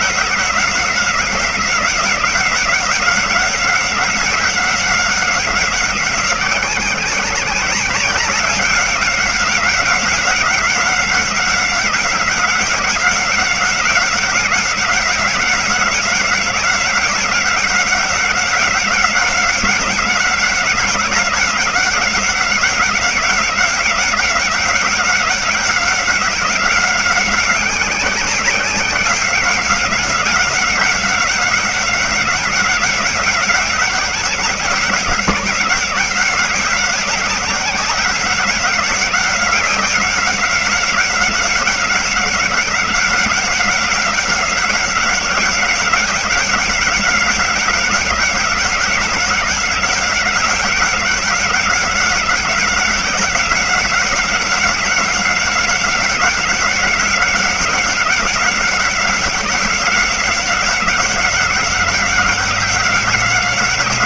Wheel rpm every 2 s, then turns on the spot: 180, 190, 190, 190, 190, 190, 190, 190, 190, 190, 190, 190, 190, 190, 190, 190, 190, 180, 190, 190, 190, 190, 190, 190, 190, 190, 190, 190, 190, 190, 190, 190.
none